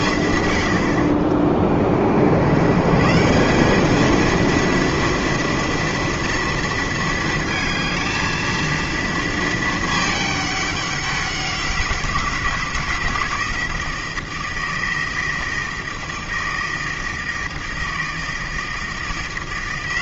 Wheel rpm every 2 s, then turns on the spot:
90, 110, 230, 230, 230, 200, 170, 160, 160, 160.
none